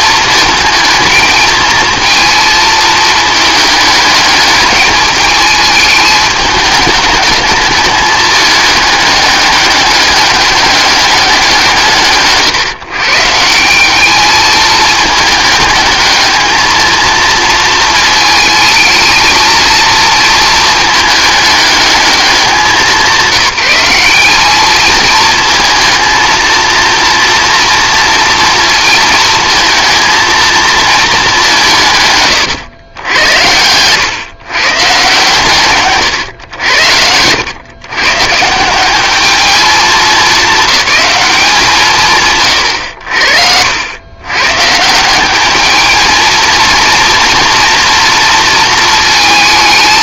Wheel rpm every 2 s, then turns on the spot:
220, 220, 210, 210, 210, 200, 150, 220, 220, 220, 220, 190, 210, 230, 230, 230, 100, 140, 90, 170, 210, 100, 150, 230, 230.
none